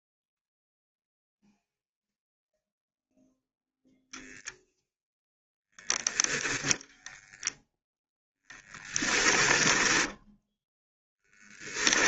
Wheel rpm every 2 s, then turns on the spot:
0, 0, 0, 0, 10, 0.
8-10